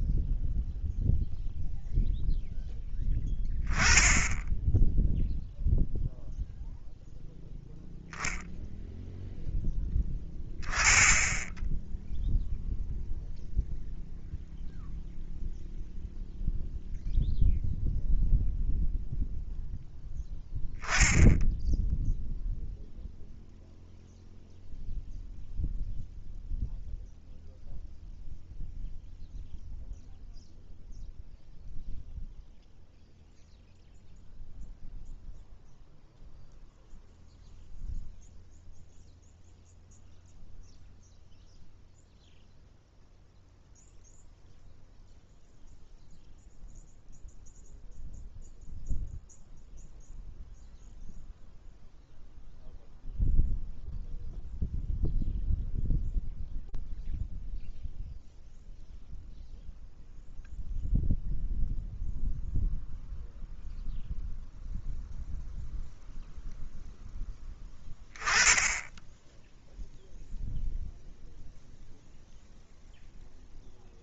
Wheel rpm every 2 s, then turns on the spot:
0, 0, 0, 0, 20, 0, 0, 0, 0, 0, 0, 0, 0, 0, 0, 0, 0, 0, 0, 0, 0, 0, 0, 0, 0, 0, 0, 0, 0, 0, 0, 0, 0, 10, 0, 0, 0.
none